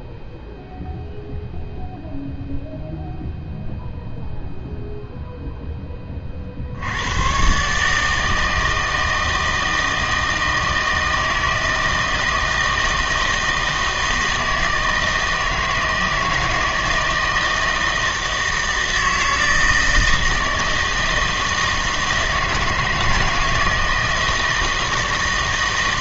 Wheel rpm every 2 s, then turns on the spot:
0, 0, 0, 60, 160, 160, 160, 160, 160, 160, 160, 160, 160.
none